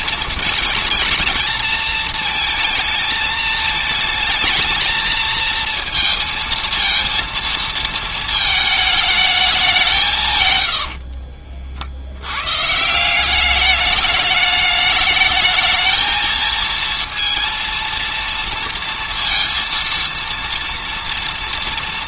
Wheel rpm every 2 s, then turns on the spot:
220, 220, 220, 230, 220, 90, 150, 210, 230, 230, 230.
10-12